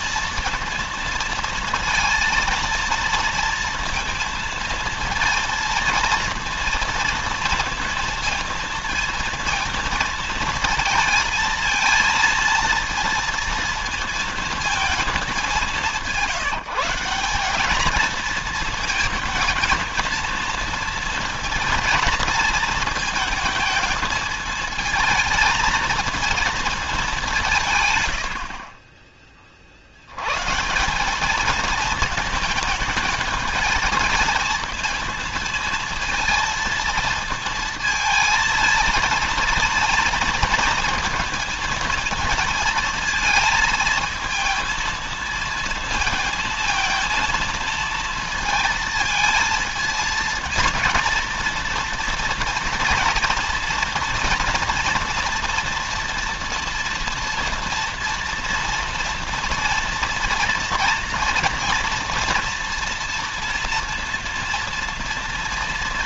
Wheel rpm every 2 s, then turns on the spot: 230, 230, 230, 230, 230, 230, 230, 220, 180, 220, 230, 220, 220, 210, 40, 190, 220, 220, 230, 230, 220, 220, 230, 230, 220, 220, 230, 230, 230, 230, 230, 230, 230.
28-30